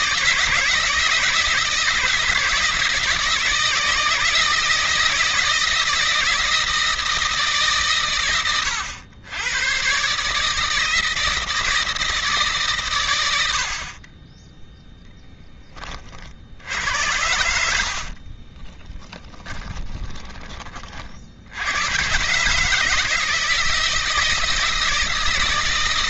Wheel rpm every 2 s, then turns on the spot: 160, 160, 170, 150, 100, 160, 80, 10, 80, 30, 60, 160, 160.
16-20